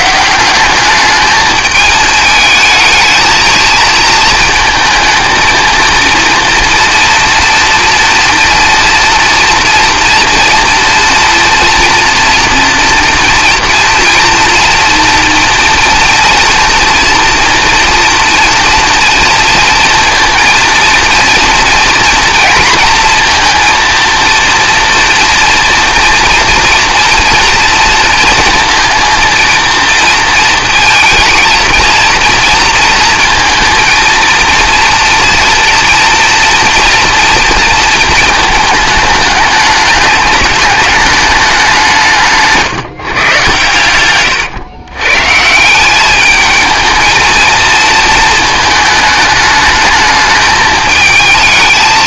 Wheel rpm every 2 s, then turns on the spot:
200, 220, 220, 230, 240, 230, 240, 230, 230, 230, 230, 230, 230, 230, 230, 220, 230, 230, 240, 210, 210, 150, 130, 220, 220, 220.
none